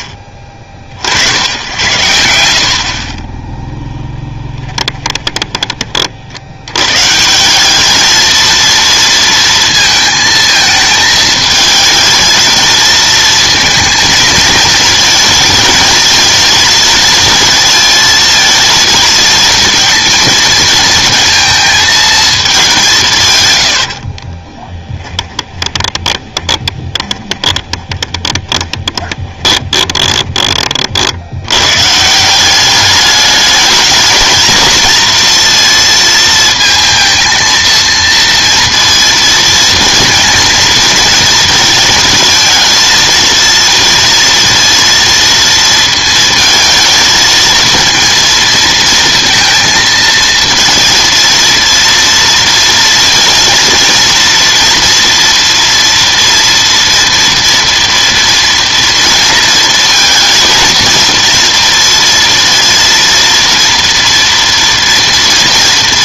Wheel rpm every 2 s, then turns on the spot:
40, 60, 20, 90, 230, 220, 230, 220, 230, 230, 230, 200, 10, 20, 20, 30, 190, 220, 220, 230, 230, 220, 230, 220, 230, 230, 230, 230, 240, 230, 230, 230, 230.
4-6 24-30